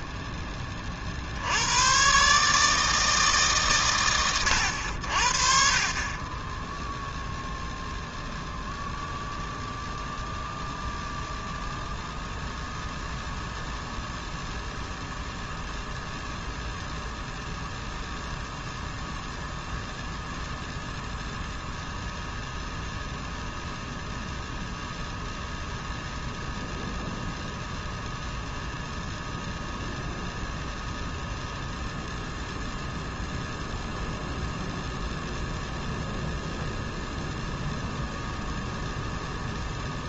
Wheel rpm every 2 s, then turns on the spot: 20, 150, 100, 10, 0, 0, 0, 0, 0, 0, 0, 0, 0, 0, 0, 0, 0, 0, 0, 0.
none